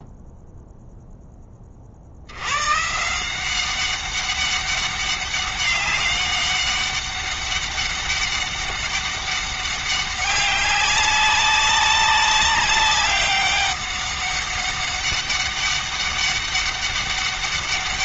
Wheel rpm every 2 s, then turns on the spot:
0, 140, 200, 200, 200, 200, 200, 200, 200.
none